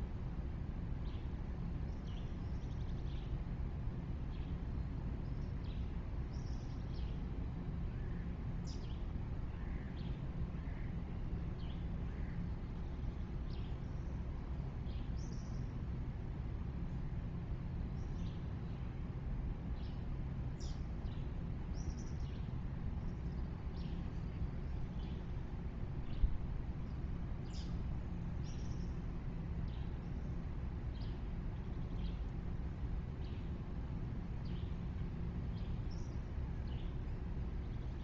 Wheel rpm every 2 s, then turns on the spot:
0, 0, 0, 0, 0, 0, 0, 0, 0, 0, 0, 0, 0, 0, 0, 0, 0, 0, 0.
none